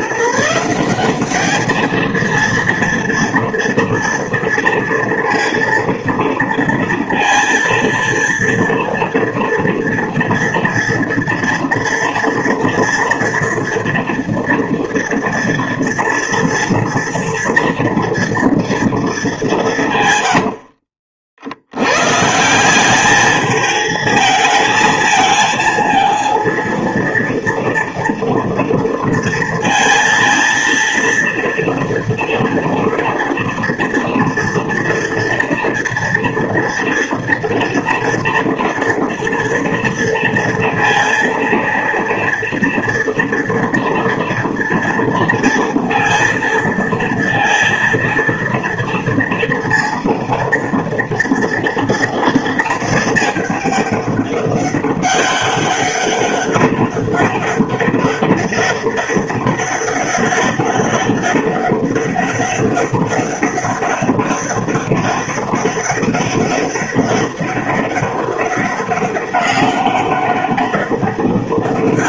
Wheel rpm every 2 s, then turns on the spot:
180, 230, 230, 230, 230, 230, 230, 230, 230, 230, 60, 200, 220, 230, 230, 230, 230, 230, 230, 230, 230, 230, 230, 230, 230, 230, 220, 200, 200, 200, 200, 200, 200, 200, 200, 200.
20-22